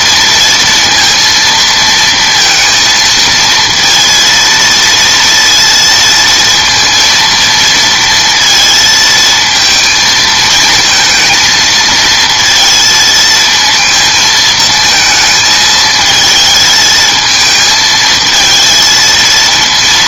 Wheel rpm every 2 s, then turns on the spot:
230, 230, 230, 230, 230, 220, 230, 230, 220, 220.
none